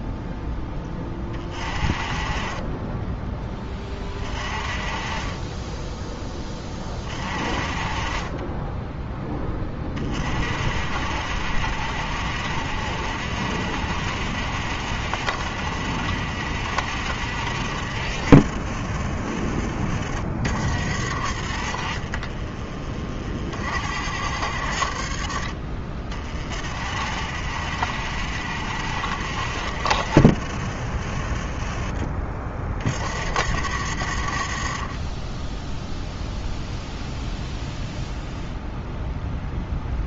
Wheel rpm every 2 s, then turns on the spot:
10, 30, 40, 30, 20, 60, 80, 80, 80, 60, 50, 30, 70, 50, 80, 50, 40, 40, 0, 0.
20-24